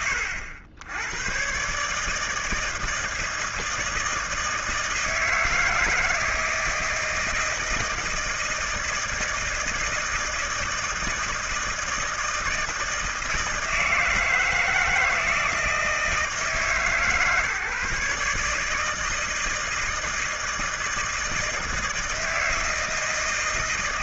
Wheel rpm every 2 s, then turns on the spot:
80, 160, 160, 160, 160, 160, 160, 160, 140, 150, 160, 160.
none